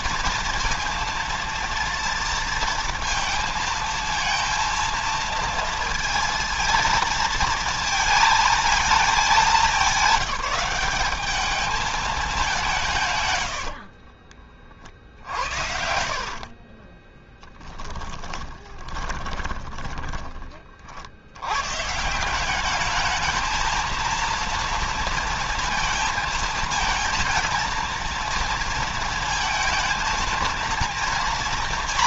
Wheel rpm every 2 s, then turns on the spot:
230, 230, 230, 230, 220, 190, 170, 50, 40, 20, 40, 190, 230, 230, 230, 230.
16-20